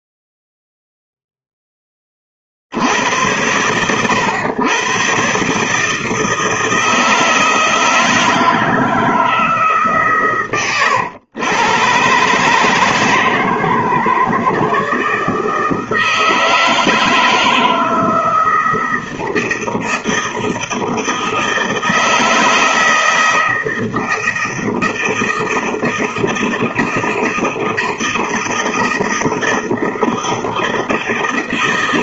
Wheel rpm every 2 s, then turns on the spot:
0, 50, 110, 160, 160, 120, 150, 160, 160, 160, 160, 160, 160, 160, 160, 160.
none